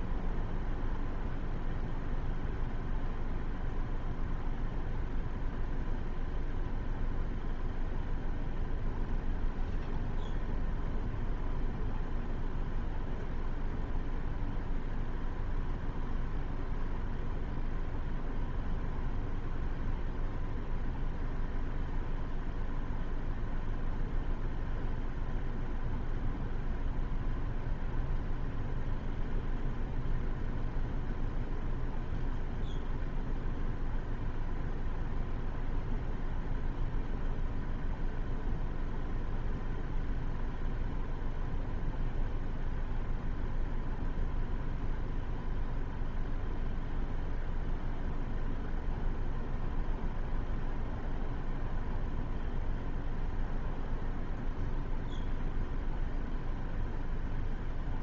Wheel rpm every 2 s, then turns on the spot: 0, 0, 0, 0, 0, 0, 0, 0, 0, 0, 0, 0, 0, 0, 0, 0, 0, 0, 0, 0, 0, 0, 0, 0, 0, 0, 0, 0, 0.
none